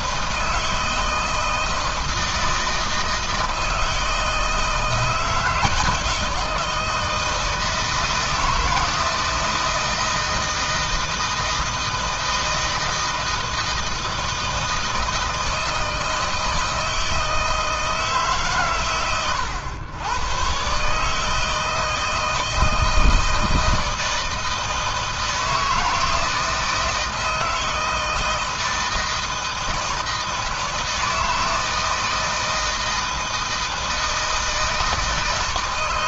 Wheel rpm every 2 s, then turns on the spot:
160, 160, 160, 160, 160, 160, 160, 160, 160, 140, 120, 160, 160, 160, 160, 160, 160, 160.
none